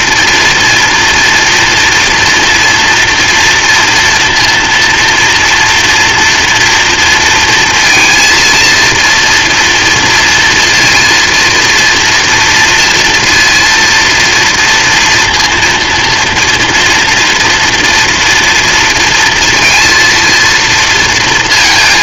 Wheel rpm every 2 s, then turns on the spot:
230, 230, 230, 230, 230, 240, 240, 230, 230, 230, 230.
none